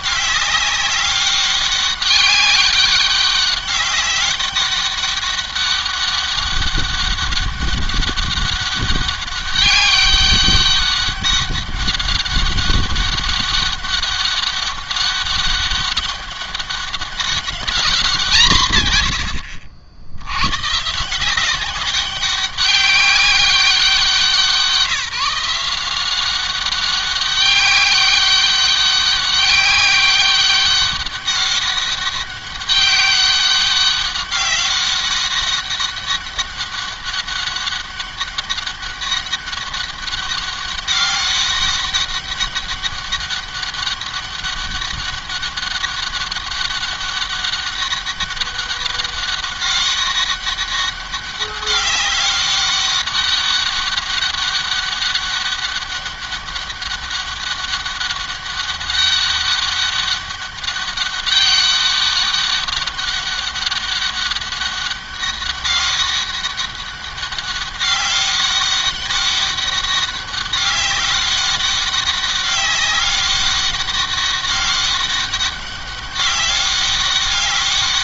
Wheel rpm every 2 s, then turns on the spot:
200, 200, 190, 200, 200, 200, 200, 200, 200, 150, 120, 200, 170, 190, 200, 200, 200, 200, 190, 200, 200, 200, 200, 200, 200, 200, 200, 200, 200, 200, 200, 200, 200, 200, 200, 200, 200, 200, 200.
none